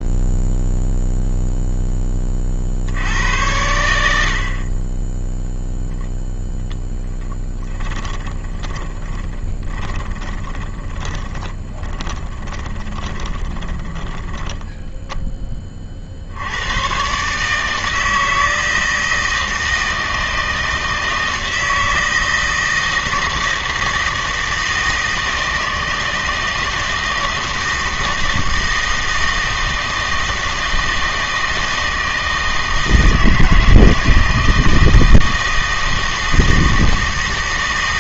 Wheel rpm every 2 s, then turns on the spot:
0, 60, 30, 0, 30, 20, 20, 10, 90, 160, 160, 160, 160, 160, 160, 160, 160, 160, 160.
8-16